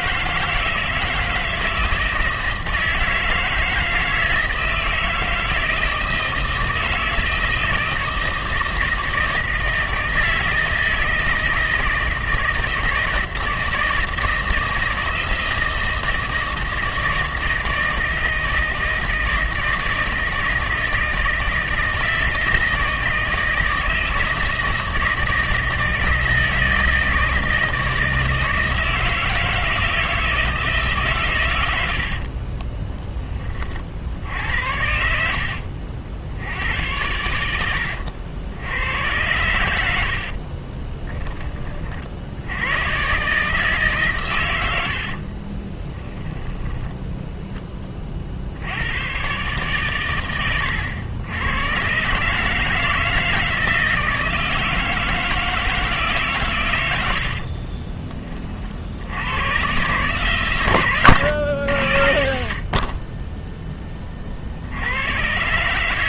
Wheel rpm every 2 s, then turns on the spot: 160, 160, 160, 160, 160, 160, 160, 160, 160, 160, 160, 160, 160, 160, 160, 150, 20, 70, 90, 90, 30, 120, 90, 10, 80, 100, 160, 160, 110, 70, 130, 70, 70.
32-34 40-42 44-48